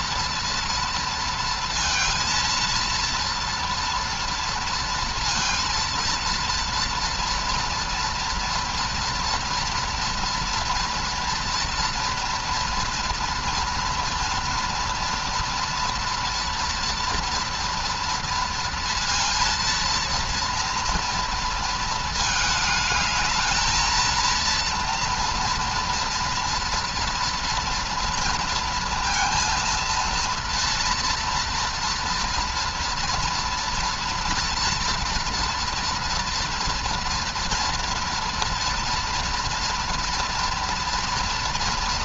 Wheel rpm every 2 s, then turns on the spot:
230, 230, 230, 230, 230, 230, 230, 230, 230, 230, 230, 220, 230, 240, 230, 230, 240, 230, 230, 230, 230.
none